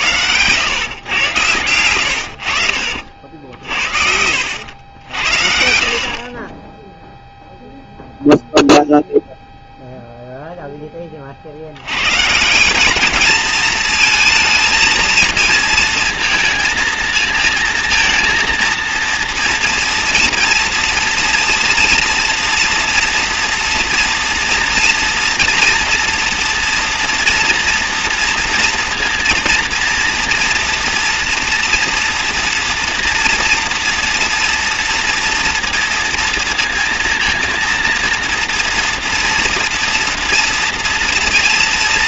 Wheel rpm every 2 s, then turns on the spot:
110, 70, 80, 30, 0, 10, 180, 230, 230, 230, 230, 230, 230, 240, 230, 240, 230, 240, 230, 230, 230.
4-6